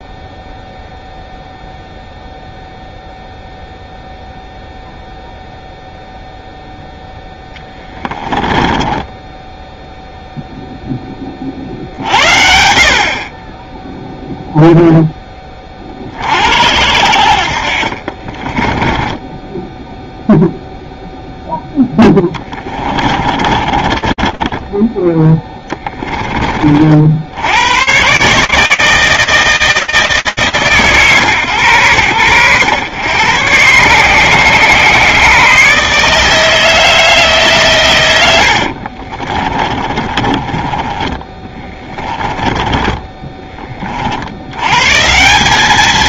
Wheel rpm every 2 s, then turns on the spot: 0, 0, 0, 0, 10, 0, 60, 0, 70, 20, 0, 40, 10, 80, 160, 110, 120, 150, 130, 30, 20, 20, 200.
8-10 18-20 22-24 38-42